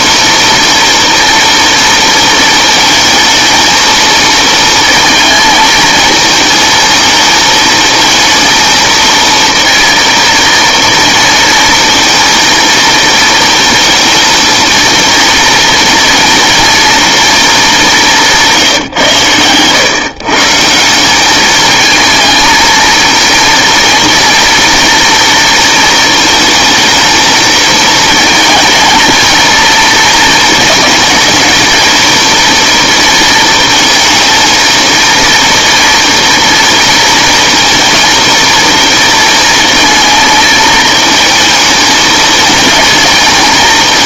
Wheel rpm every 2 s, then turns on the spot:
230, 220, 230, 220, 220, 230, 230, 230, 230, 160, 160, 230, 230, 220, 220, 220, 230, 230, 230, 230, 220, 230.
none